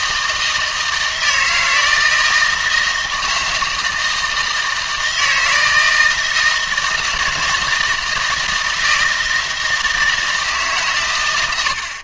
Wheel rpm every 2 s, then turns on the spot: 160, 160, 160, 160, 160, 150.
none